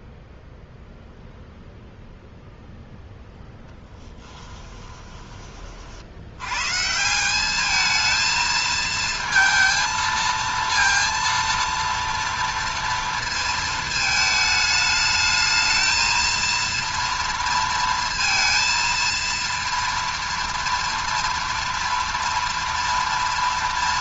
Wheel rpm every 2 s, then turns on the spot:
0, 0, 20, 160, 230, 230, 230, 220, 230, 230, 240, 230.
4-6